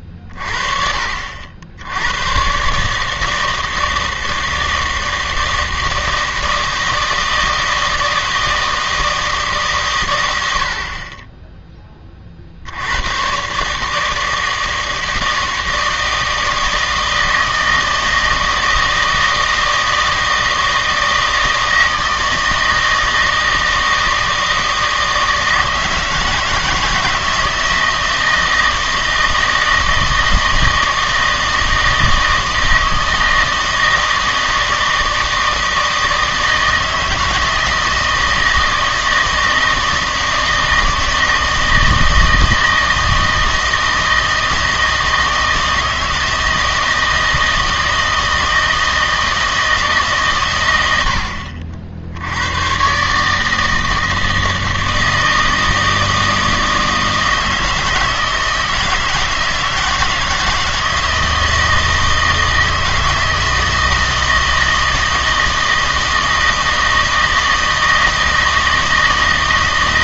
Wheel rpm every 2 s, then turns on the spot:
30, 140, 160, 160, 160, 70, 70, 160, 160, 160, 160, 160, 160, 160, 160, 160, 160, 160, 160, 160, 160, 160, 160, 160, 160, 110, 110, 160, 160, 160, 160, 160, 160, 160, 160.
none